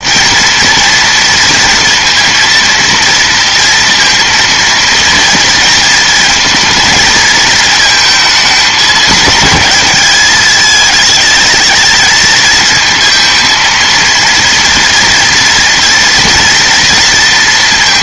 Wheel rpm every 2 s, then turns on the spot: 230, 230, 230, 230, 220, 210, 220, 230, 230.
none